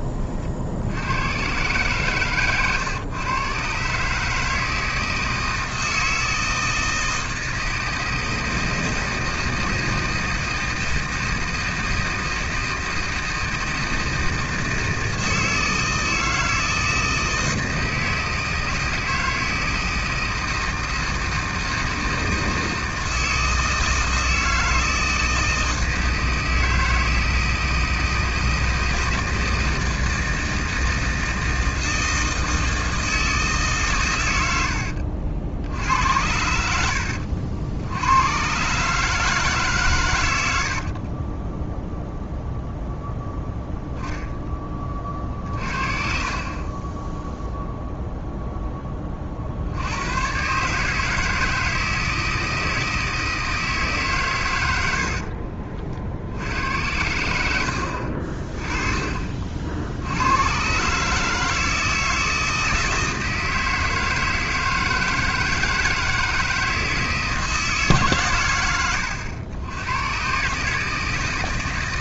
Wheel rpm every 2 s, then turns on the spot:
60, 120, 160, 160, 160, 160, 160, 160, 160, 160, 160, 160, 160, 160, 160, 160, 160, 80, 70, 140, 70, 0, 20, 20, 10, 150, 160, 90, 80, 30, 130, 160, 160, 160, 110, 150.
40-42